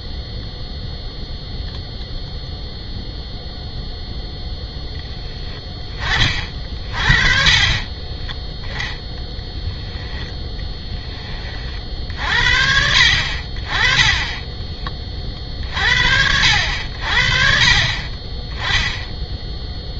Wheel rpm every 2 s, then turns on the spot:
0, 0, 10, 30, 10, 10, 60, 20, 70, 10.
none